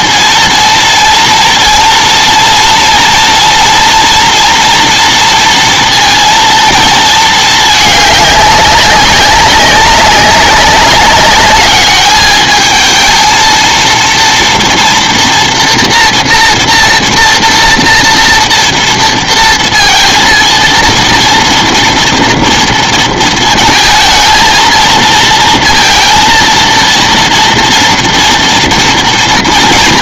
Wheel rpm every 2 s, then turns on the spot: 230, 230, 230, 230, 200, 190, 220, 240, 240, 230, 230, 230, 230, 230, 230.
none